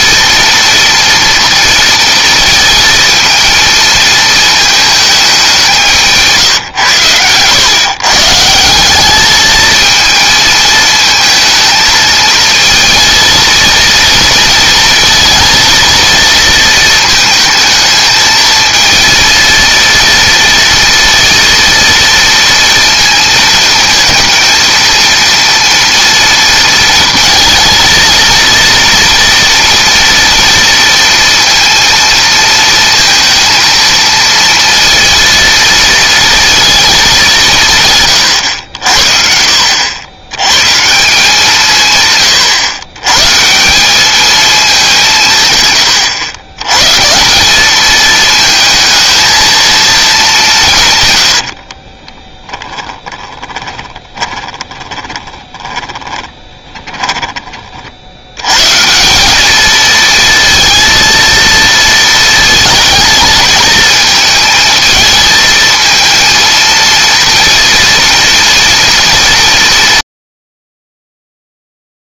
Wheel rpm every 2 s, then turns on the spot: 230, 220, 210, 120, 200, 220, 220, 230, 220, 230, 230, 230, 230, 230, 230, 230, 230, 230, 210, 60, 160, 130, 170, 150, 220, 130, 10, 20, 20, 170, 230, 230, 220, 230, 230, 40.
52-58